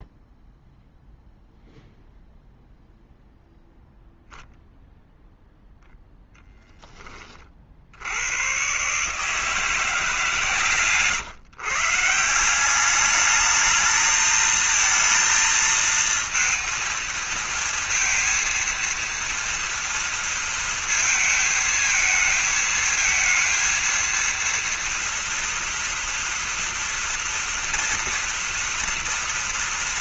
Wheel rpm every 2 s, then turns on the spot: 0, 0, 0, 0, 110, 150, 190, 220, 230, 230, 230, 220, 230, 230, 230.
10-12